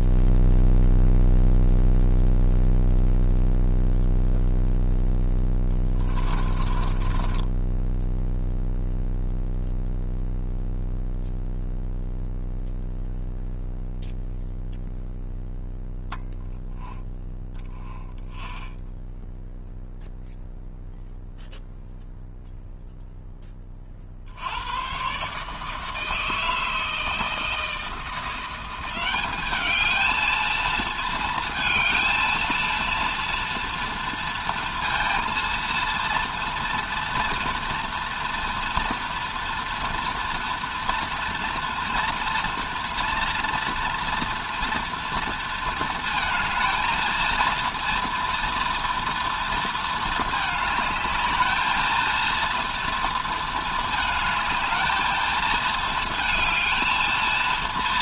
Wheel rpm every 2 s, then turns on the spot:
0, 0, 0, 20, 0, 0, 0, 0, 0, 0, 0, 0, 110, 160, 190, 230, 230, 230, 240, 230, 230, 230, 230, 220, 230, 210, 230, 220, 220.
6-8